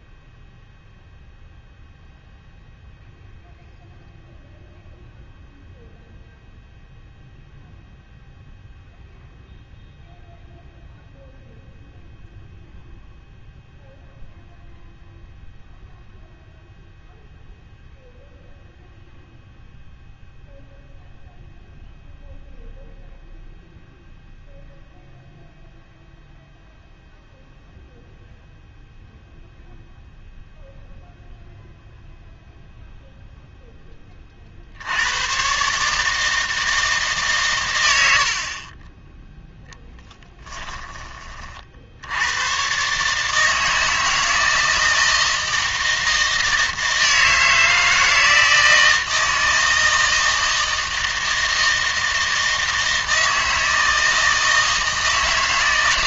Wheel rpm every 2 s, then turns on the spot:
0, 0, 0, 0, 0, 0, 0, 0, 0, 0, 0, 0, 0, 0, 0, 0, 0, 60, 160, 30, 10, 120, 160, 160, 160, 160, 160, 160.
40-42